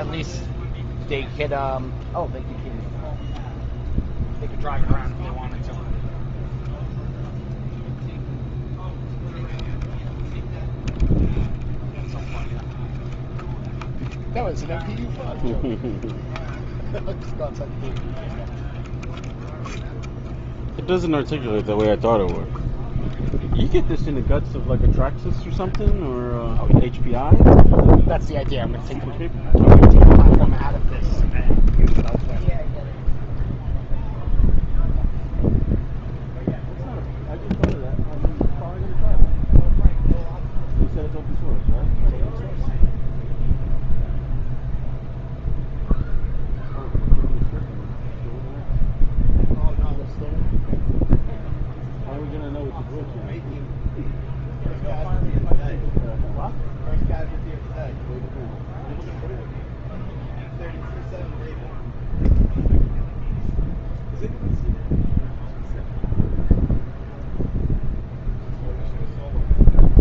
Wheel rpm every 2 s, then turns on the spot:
0, 0, 0, 0, 0, 0, 0, 0, 0, 0, 0, 0, 0, 0, 0, 0, 0, 0, 0, 0, 0, 0, 0, 0, 0, 0, 0, 0, 0, 0, 0, 0, 0, 0, 0.
none